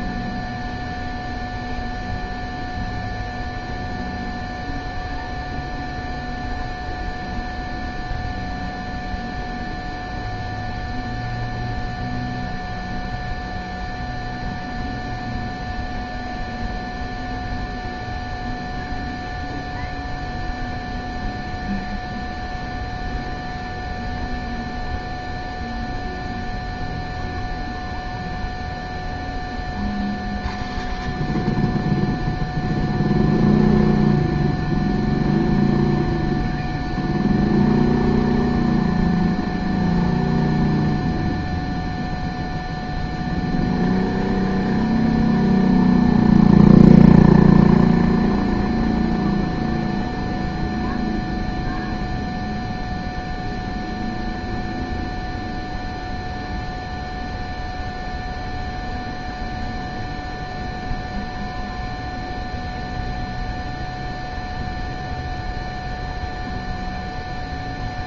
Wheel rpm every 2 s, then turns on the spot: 0, 0, 0, 0, 0, 0, 0, 0, 0, 0, 0, 0, 0, 0, 0, 0, 0, 0, 0, 0, 0, 0, 0, 0, 0, 0, 0, 0, 0, 0, 0, 0, 0, 0.
none